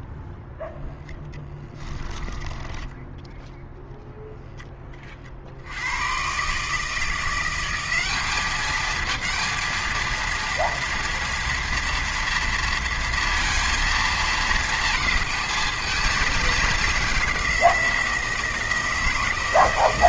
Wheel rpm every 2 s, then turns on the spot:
0, 10, 10, 150, 210, 230, 230, 220, 210, 160.
2-4